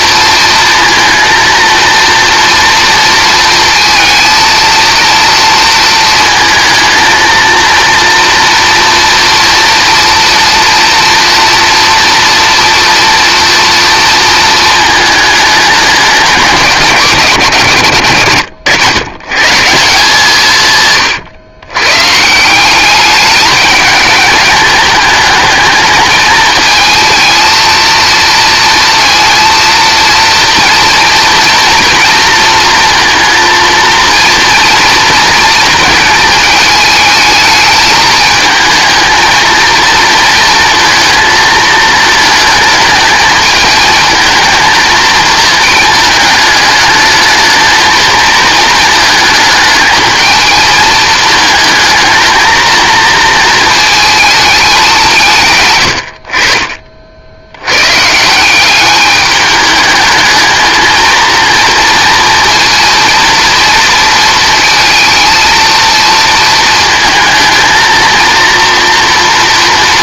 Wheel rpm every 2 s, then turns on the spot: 230, 230, 230, 230, 230, 230, 230, 220, 170, 110, 130, 190, 210, 220, 230, 230, 230, 230, 220, 220, 230, 210, 220, 220, 220, 220, 230, 190, 60, 200, 220, 240, 230, 220, 230.
20-22